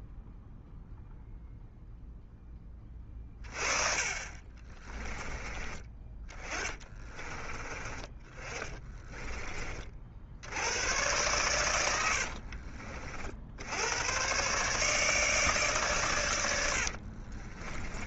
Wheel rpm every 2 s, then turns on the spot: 0, 20, 30, 20, 30, 100, 50, 140, 70.
4-10 16-18